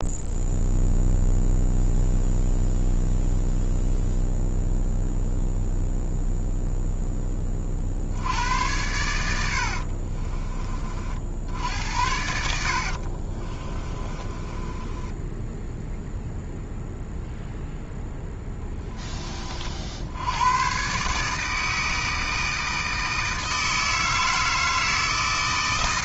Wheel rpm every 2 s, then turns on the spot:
0, 0, 0, 0, 90, 40, 50, 10, 0, 10, 130, 160, 160.
12-16